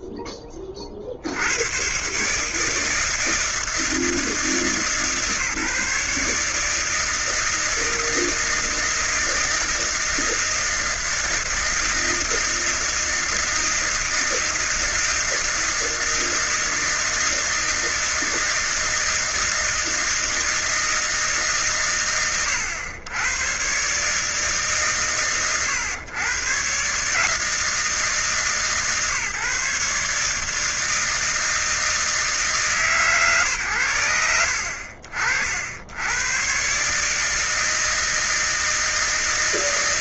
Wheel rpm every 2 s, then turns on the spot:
20, 150, 160, 150, 160, 160, 160, 160, 160, 160, 160, 80, 150, 120, 140, 160, 150, 40, 130, 160.
none